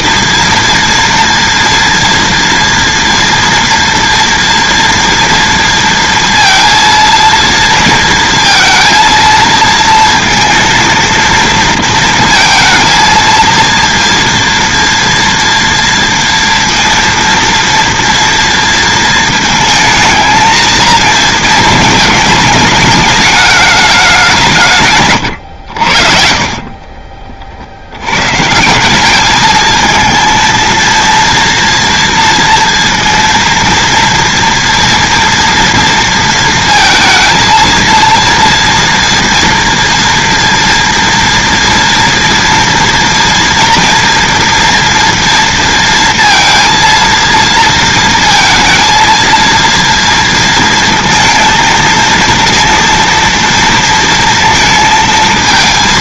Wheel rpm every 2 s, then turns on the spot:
230, 230, 230, 230, 230, 230, 220, 230, 230, 230, 220, 210, 160, 40, 150, 230, 230, 230, 230, 230, 230, 230, 230, 230, 230, 230, 230, 230.
26-28